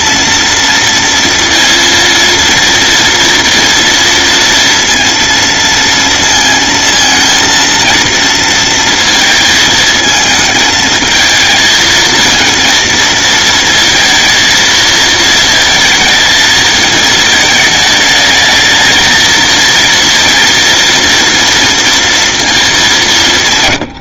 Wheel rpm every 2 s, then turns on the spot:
230, 230, 230, 230, 230, 220, 230, 220, 220, 220, 230, 180.
none